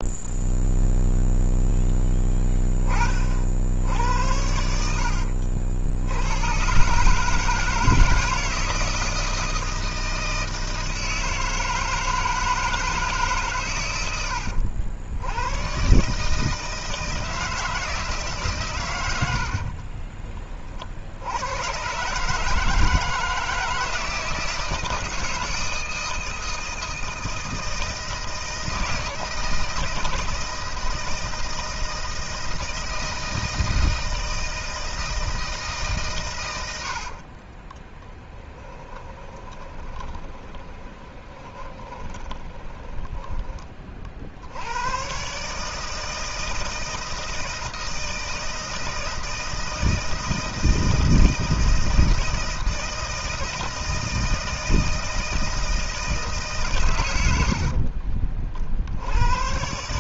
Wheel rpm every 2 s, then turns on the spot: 0, 30, 80, 140, 160, 160, 160, 90, 160, 110, 50, 150, 160, 160, 160, 160, 160, 160, 70, 20, 20, 20, 110, 160, 160, 160, 160, 160, 110, 70.
4-6 18-20 36-44